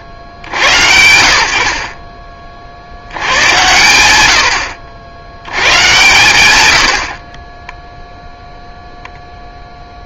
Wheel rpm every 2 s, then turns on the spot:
70, 30, 110, 40, 0.
none